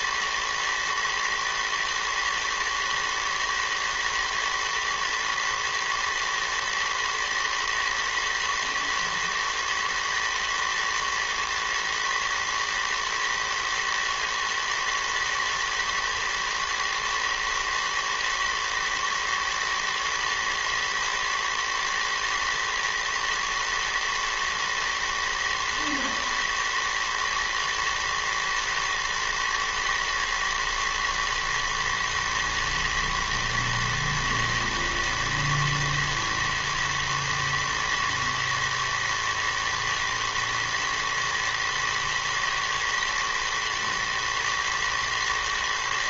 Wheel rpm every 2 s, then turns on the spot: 110, 110, 110, 110, 110, 110, 120, 110, 110, 110, 110, 110, 110, 110, 120, 110, 110, 110, 110, 120, 110, 110, 110.
none